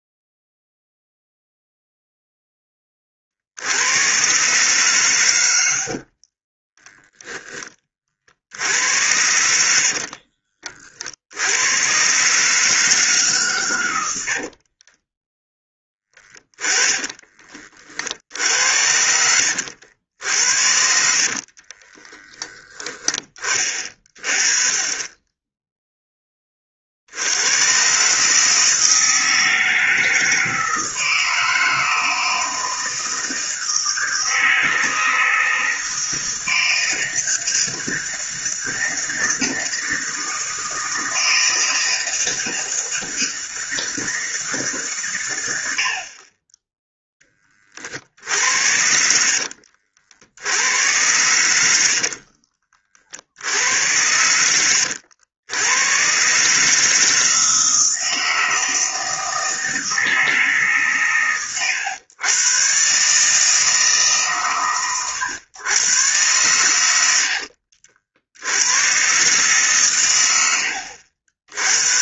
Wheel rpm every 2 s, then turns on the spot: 0, 10, 130, 40, 70, 40, 150, 40, 20, 70, 60, 10, 30, 50, 160, 160, 160, 160, 160, 160, 160, 160, 130, 20, 70, 100, 50, 90, 160, 160, 130, 140, 120, 80, 130, 70.
6-8 14-18 20-22 48-50